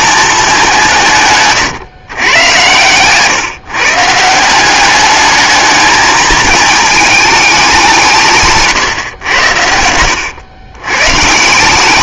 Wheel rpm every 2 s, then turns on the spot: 180, 110, 190, 210, 140, 120.
2-4